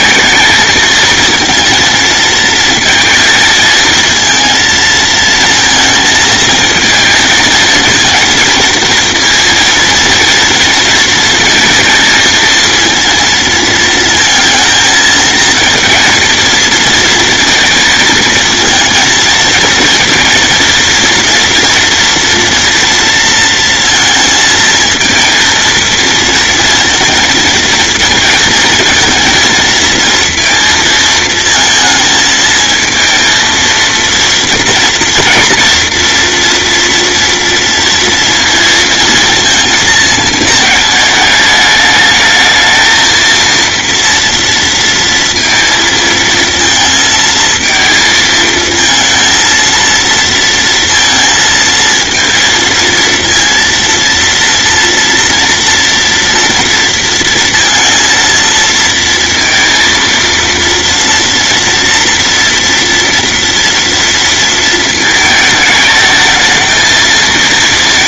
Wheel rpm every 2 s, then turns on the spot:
220, 230, 230, 230, 230, 230, 230, 230, 230, 230, 230, 230, 230, 230, 230, 230, 230, 230, 230, 230, 210, 220, 230, 230, 220, 230, 230, 230, 230, 230, 230, 230, 220, 220.
none